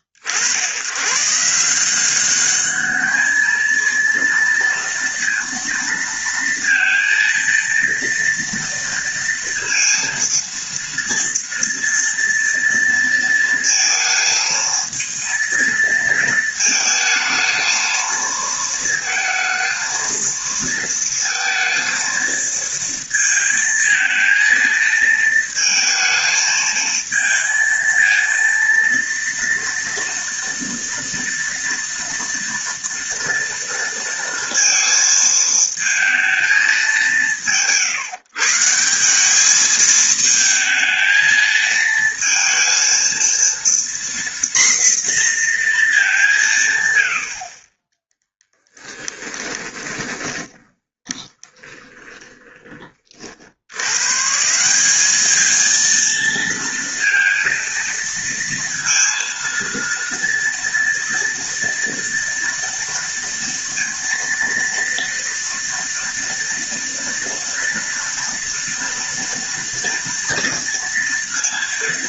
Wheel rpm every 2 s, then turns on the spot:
90, 210, 230, 230, 230, 230, 230, 220, 220, 230, 230, 230, 230, 220, 230, 230, 230, 230, 180, 160, 220, 230, 240, 120, 10, 20, 30, 180, 230, 230, 230, 230, 230, 230, 230, 230.
48-52